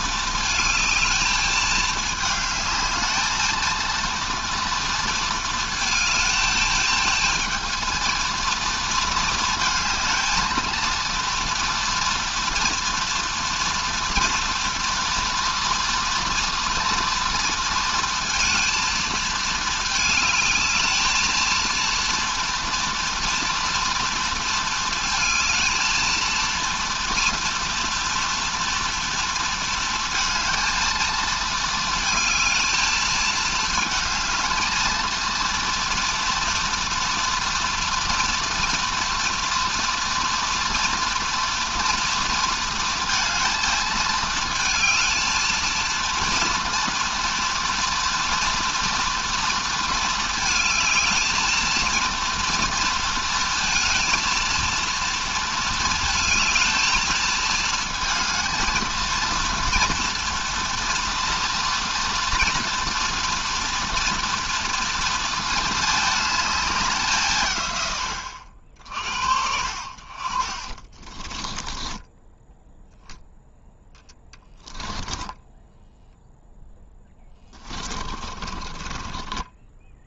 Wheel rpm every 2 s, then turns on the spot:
220, 220, 230, 220, 220, 230, 230, 230, 230, 230, 220, 230, 220, 230, 230, 230, 220, 230, 230, 230, 230, 230, 230, 230, 230, 220, 230, 230, 220, 230, 230, 230, 230, 190, 60, 20, 0, 10, 0, 20.
70-72 74-76 78-80